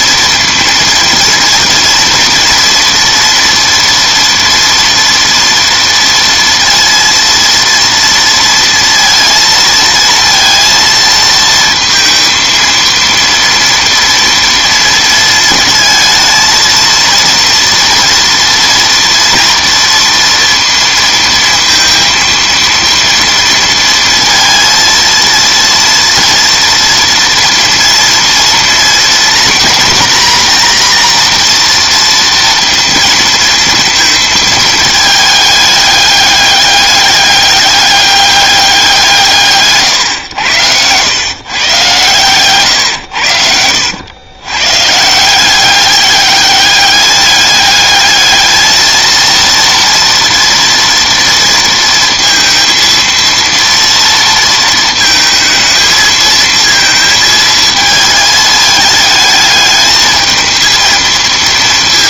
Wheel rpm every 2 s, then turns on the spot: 230, 230, 230, 230, 230, 230, 230, 230, 220, 230, 230, 230, 230, 240, 230, 240, 230, 220, 200, 190, 100, 120, 120, 200, 220, 230, 230, 230, 220, 220, 220.
none